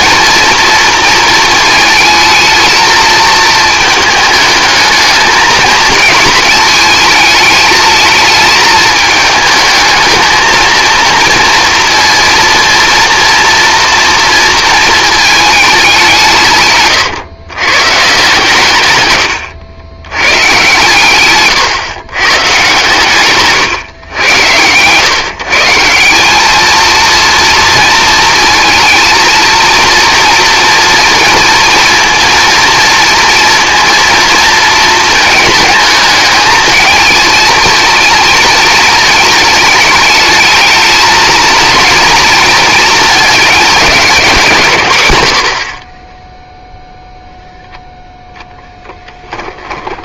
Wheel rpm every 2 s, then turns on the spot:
230, 230, 220, 220, 220, 220, 230, 230, 130, 130, 130, 140, 120, 230, 220, 230, 230, 220, 220, 230, 220, 220, 130, 0, 0.
16-18